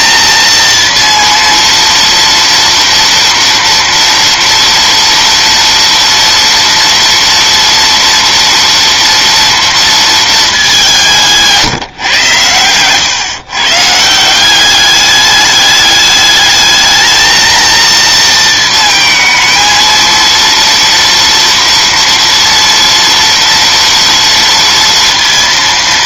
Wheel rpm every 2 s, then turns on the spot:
230, 230, 230, 230, 240, 200, 110, 190, 210, 220, 230, 230, 230.
none